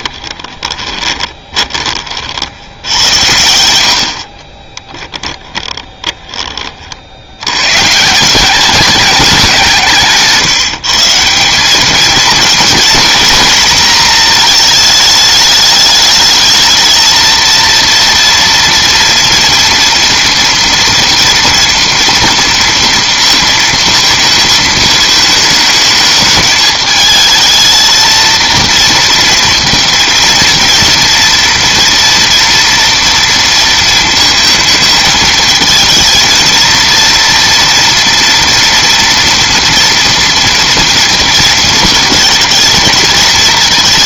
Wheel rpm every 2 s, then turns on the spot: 20, 70, 20, 30, 190, 150, 240, 220, 220, 230, 230, 230, 220, 220, 230, 230, 230, 220, 230, 230, 240, 220.
0-2 4-6